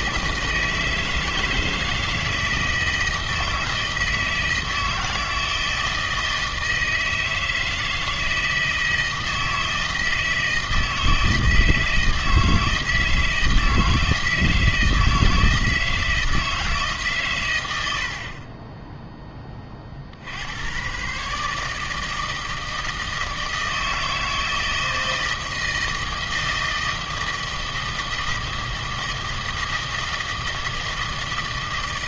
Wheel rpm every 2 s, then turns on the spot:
160, 160, 160, 160, 160, 160, 160, 160, 160, 20, 80, 160, 160, 160, 160, 160.
none